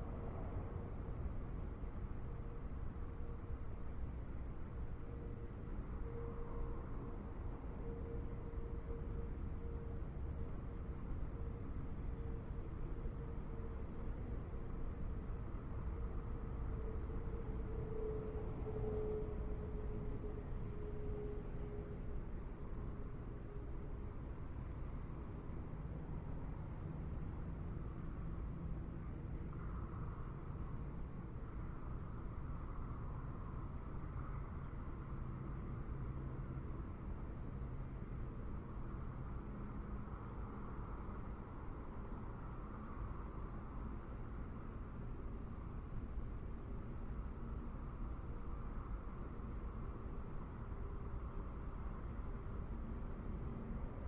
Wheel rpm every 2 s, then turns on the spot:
0, 0, 0, 0, 0, 0, 0, 0, 0, 0, 0, 0, 0, 0, 0, 0, 0, 0, 0, 0, 0, 0, 0, 0, 0, 0, 0.
none